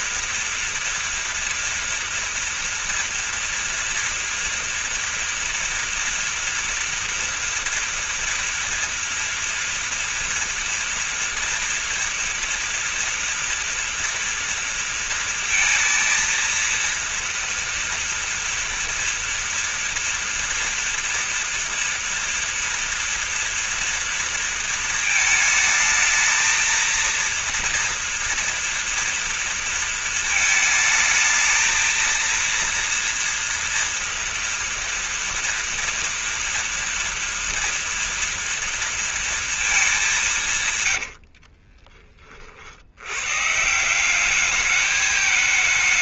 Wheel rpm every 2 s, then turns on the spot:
230, 240, 230, 230, 230, 230, 230, 230, 230, 230, 230, 240, 220, 230, 230, 220, 230, 240, 230, 230, 130, 70, 210.
none